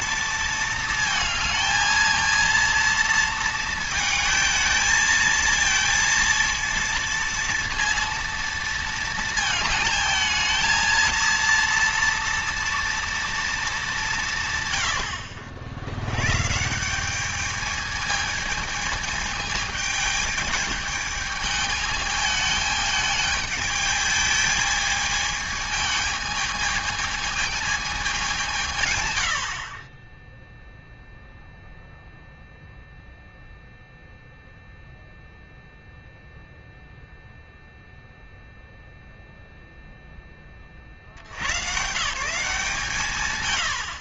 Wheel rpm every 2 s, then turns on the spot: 220, 230, 220, 230, 230, 220, 240, 130, 170, 220, 210, 210, 220, 220, 130, 0, 0, 0, 0, 0, 40, 150.
none